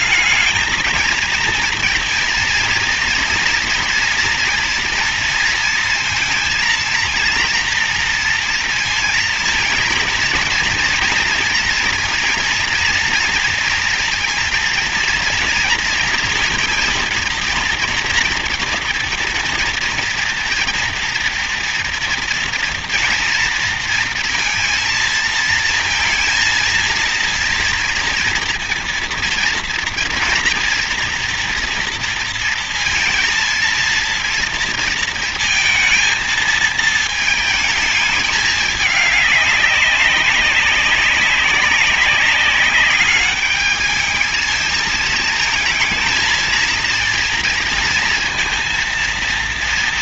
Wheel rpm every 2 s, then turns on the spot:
210, 230, 230, 230, 230, 230, 230, 230, 230, 230, 240, 230, 230, 230, 230, 230, 230, 230, 220, 210, 190, 190, 220, 230, 230.
none